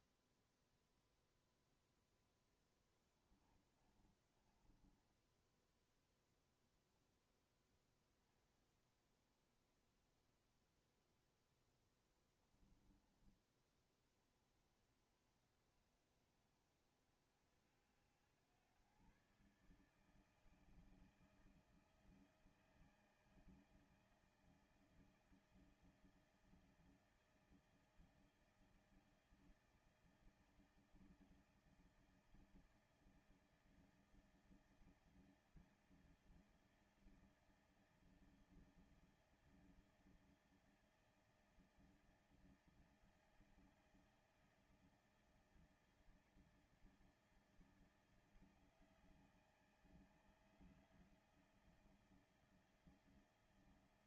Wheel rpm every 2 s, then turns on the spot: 0, 0, 30, 10, 10, 20, 10, 20, 40, 60, 140, 160, 160, 160, 160, 160, 160, 160, 160, 160, 160, 160, 160, 160, 160, 160, 160.
4-8